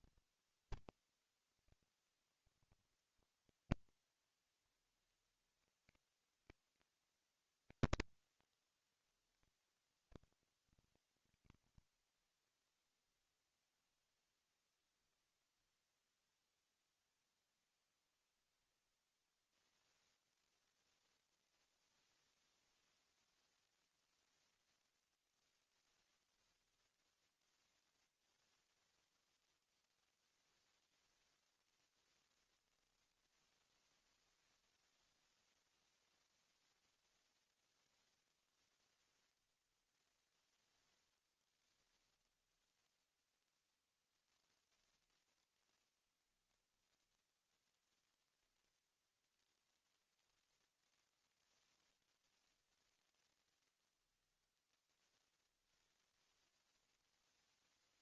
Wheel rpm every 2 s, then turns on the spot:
70, 80, 130, 190, 130, 140, 10, 0, 0, 0, 0, 0, 0, 0, 0, 0, 0, 0, 0, 0, 0, 0, 0, 0, 0, 0, 0, 0, 0.
12-14